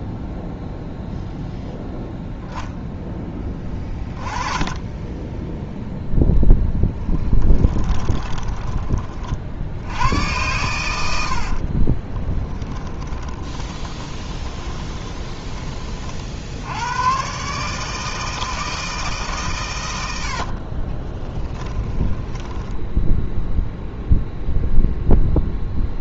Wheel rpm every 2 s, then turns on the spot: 0, 0, 20, 10, 30, 100, 20, 20, 100, 160, 30, 10, 0.
6-8 12-16 20-22